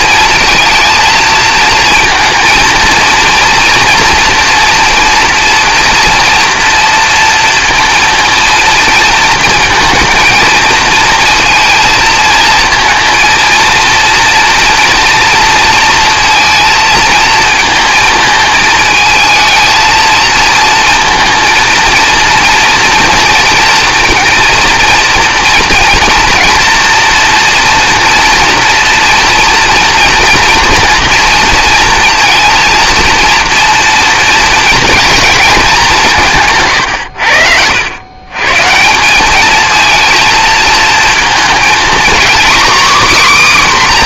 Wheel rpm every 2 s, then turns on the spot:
230, 230, 240, 230, 230, 230, 230, 230, 220, 220, 220, 230, 230, 230, 230, 230, 230, 220, 130, 160, 220, 270.
none